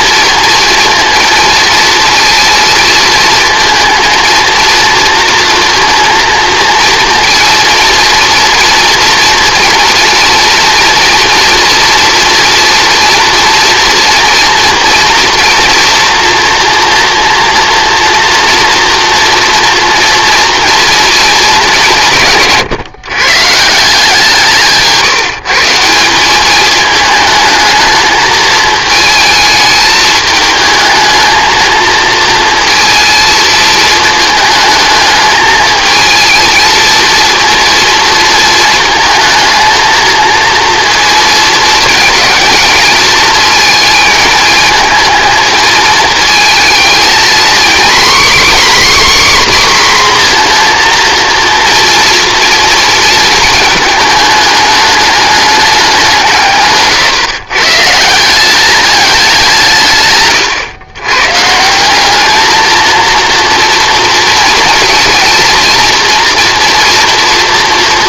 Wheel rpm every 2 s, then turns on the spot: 230, 230, 230, 230, 240, 230, 240, 230, 230, 230, 230, 130, 160, 220, 220, 220, 230, 220, 230, 220, 230, 230, 220, 220, 290, 230, 230, 210, 140, 210, 120, 230, 230, 230.
none